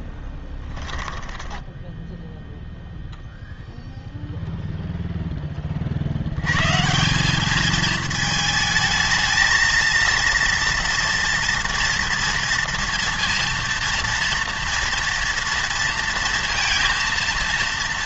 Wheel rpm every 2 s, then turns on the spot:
10, 0, 0, 140, 220, 240, 230, 230, 230.
0-2